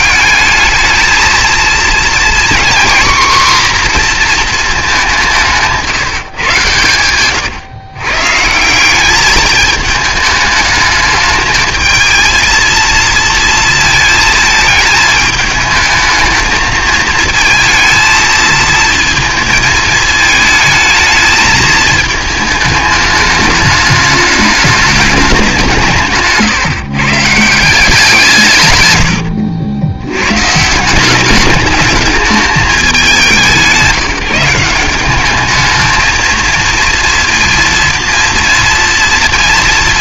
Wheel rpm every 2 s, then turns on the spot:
210, 250, 220, 120, 170, 220, 230, 220, 220, 220, 220, 210, 210, 140, 150, 130, 210, 180, 230, 230.
none